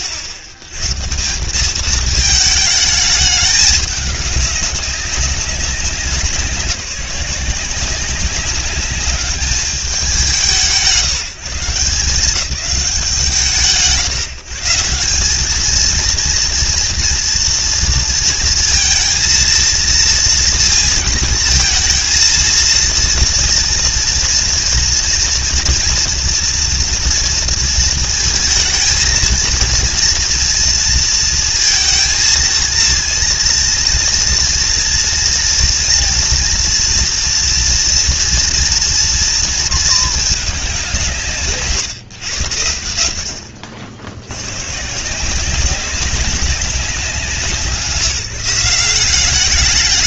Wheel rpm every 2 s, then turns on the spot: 130, 210, 190, 170, 190, 170, 180, 160, 230, 230, 230, 230, 230, 230, 220, 230, 230, 240, 240, 230, 190, 80, 130, 180, 180.
none